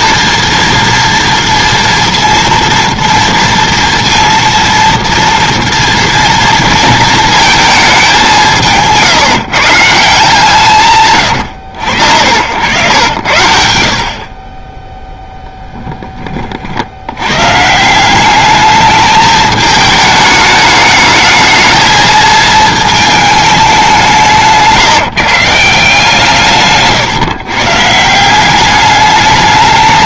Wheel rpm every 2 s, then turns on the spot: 230, 230, 230, 230, 170, 150, 100, 20, 50, 210, 220, 220, 160, 160, 190.
none